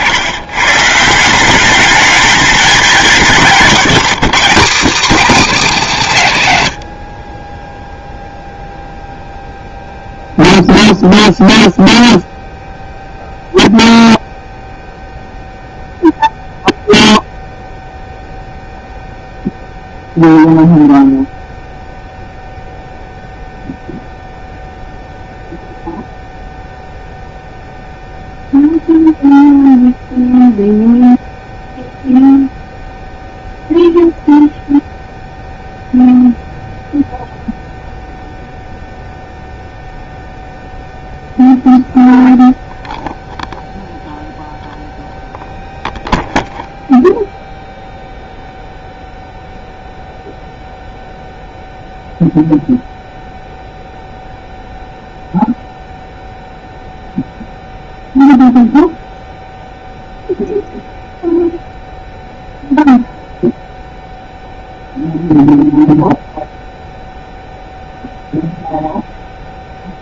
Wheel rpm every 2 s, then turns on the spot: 140, 220, 240, 90, 0, 0, 0, 0, 0, 0, 0, 0, 0, 0, 0, 0, 0, 0, 0, 0, 0, 0, 0, 0, 0, 0, 0, 0, 0, 0, 0, 0, 0, 0, 0.
6-8